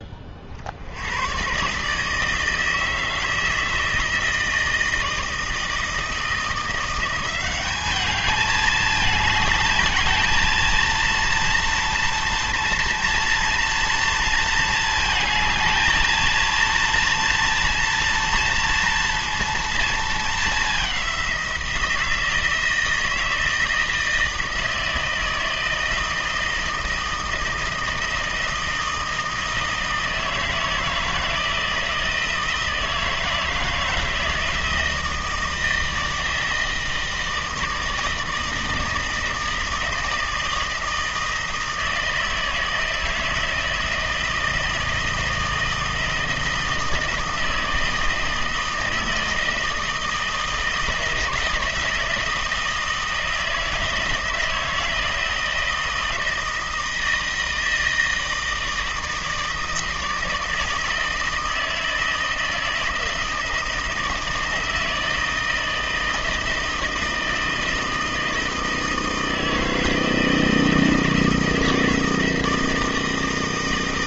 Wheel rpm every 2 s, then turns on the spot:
60, 160, 160, 170, 210, 230, 230, 220, 230, 230, 210, 160, 160, 160, 160, 160, 160, 160, 160, 160, 160, 160, 160, 160, 160, 160, 160, 160, 160, 160, 160, 160, 160, 160, 160, 160, 160.
none